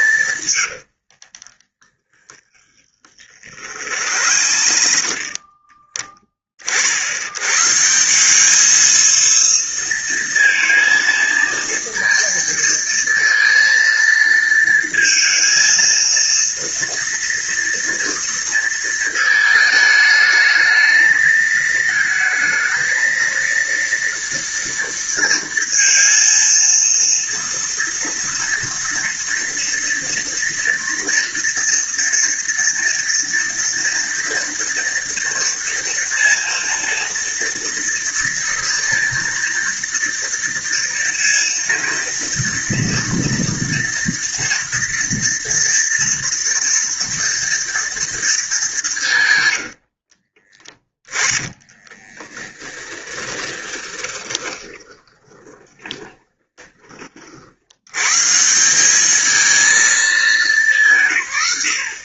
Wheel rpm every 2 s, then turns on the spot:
60, 30, 40, 70, 220, 230, 230, 230, 230, 220, 220, 220, 230, 230, 230, 230, 230, 230, 230, 230, 230, 230, 230, 230, 160, 10, 20, 20, 50, 200, 160.
0-4 50-56